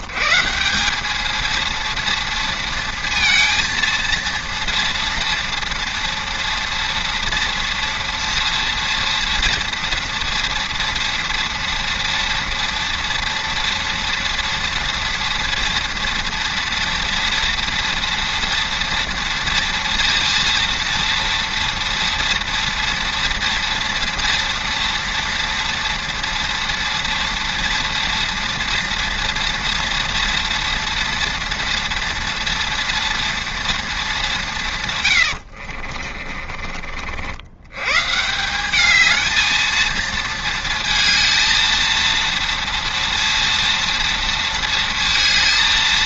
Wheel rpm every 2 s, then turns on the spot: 160, 230, 230, 230, 230, 230, 230, 230, 230, 230, 230, 230, 230, 230, 230, 230, 230, 170, 40, 190, 230, 230, 230.
36-38